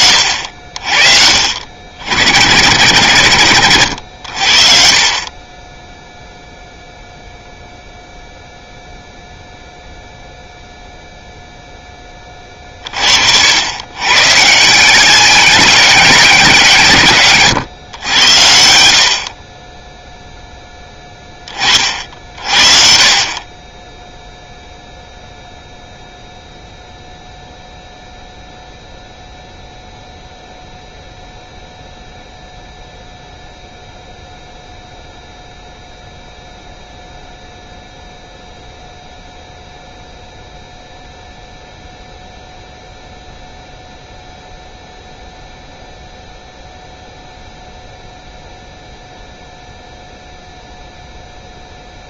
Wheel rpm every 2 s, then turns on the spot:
60, 100, 50, 0, 0, 0, 50, 170, 120, 70, 10, 50, 0, 0, 0, 0, 0, 0, 0, 0, 0, 0, 0, 0, 0, 0.
4-6